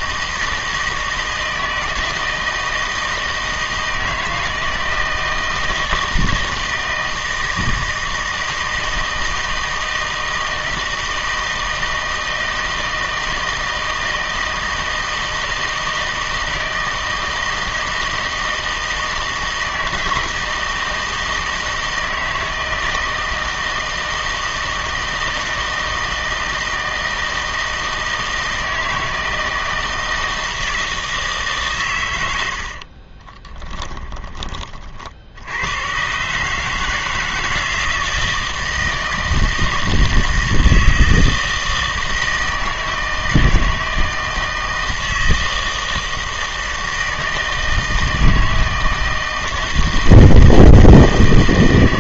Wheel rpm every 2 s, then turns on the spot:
160, 160, 160, 160, 160, 160, 160, 160, 160, 160, 160, 160, 160, 160, 160, 160, 60, 40, 150, 160, 160, 160, 160, 160, 160, 160.
32-34